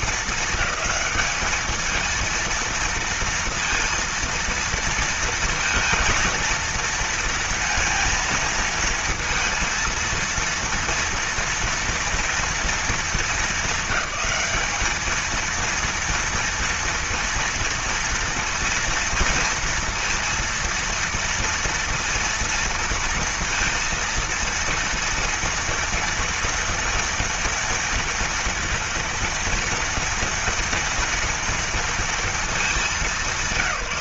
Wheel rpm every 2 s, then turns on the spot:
220, 230, 230, 230, 230, 230, 230, 220, 230, 230, 230, 230, 230, 230, 230, 230, 210.
none